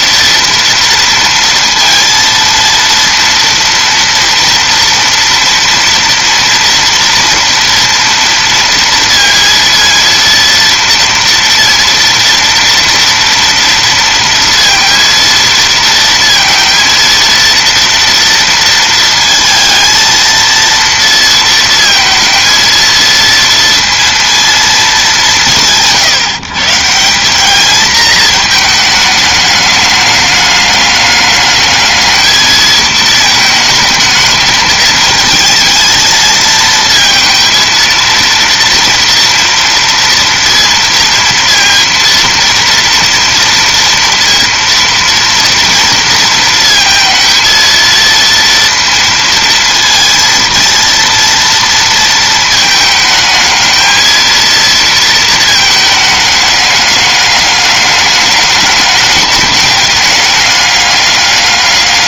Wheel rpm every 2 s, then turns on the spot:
230, 230, 230, 230, 230, 230, 230, 230, 230, 230, 230, 230, 220, 160, 220, 210, 220, 210, 220, 230, 230, 230, 240, 230, 230, 230, 220, 230, 210, 210, 200.
none